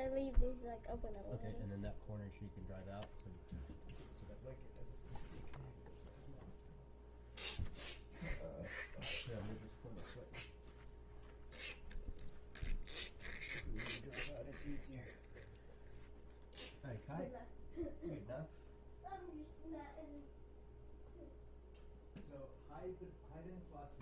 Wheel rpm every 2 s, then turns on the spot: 0, 0, 0, 0, 0, 0, 0, 0, 0, 0, 0, 0.
none